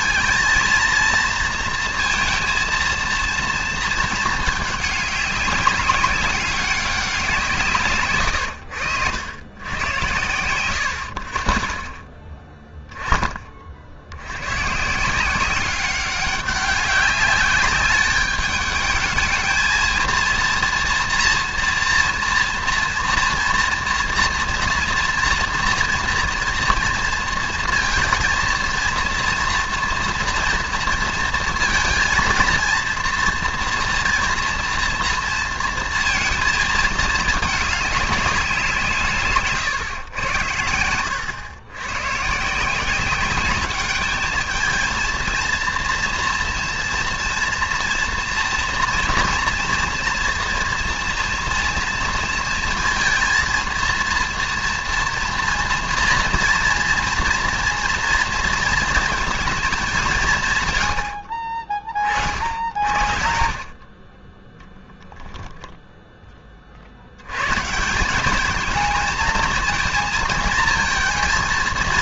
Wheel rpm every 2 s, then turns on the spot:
230, 230, 210, 190, 90, 110, 10, 120, 200, 210, 240, 230, 230, 230, 230, 230, 230, 230, 220, 170, 90, 160, 220, 230, 240, 230, 230, 230, 230, 230, 130, 50, 10, 40, 220, 220.
none